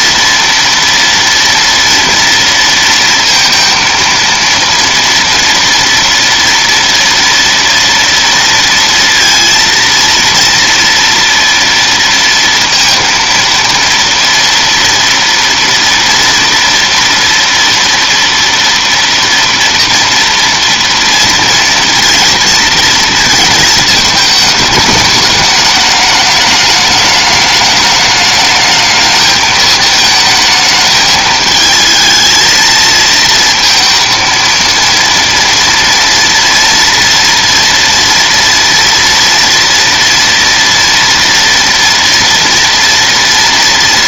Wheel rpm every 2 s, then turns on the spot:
230, 230, 230, 230, 230, 230, 230, 240, 230, 240, 230, 230, 210, 210, 220, 220, 230, 230, 230, 230, 230, 230.
none